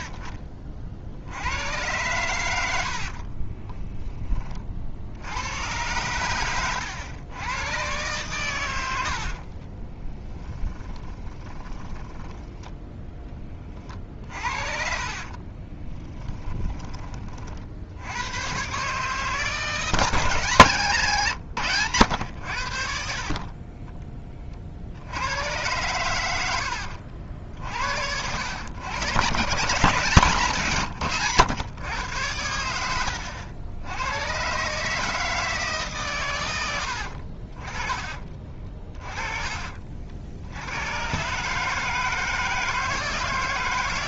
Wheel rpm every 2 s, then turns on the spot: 50, 90, 50, 100, 90, 20, 20, 40, 30, 140, 140, 50, 70, 70, 110, 130, 80, 150, 80, 30, 100, 160.
2-4 10-12 14-16 20-22 26-28 32-34 38-40